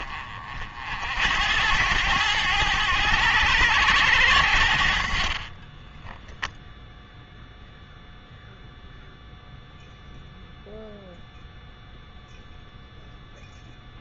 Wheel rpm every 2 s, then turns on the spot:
60, 110, 70, 0, 0, 0, 0.
none